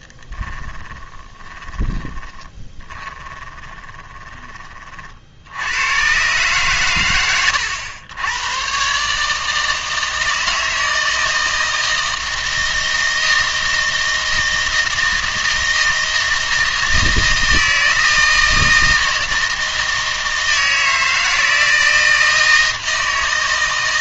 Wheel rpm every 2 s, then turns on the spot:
20, 20, 50, 130, 130, 160, 160, 160, 160, 160, 160, 160.
0-4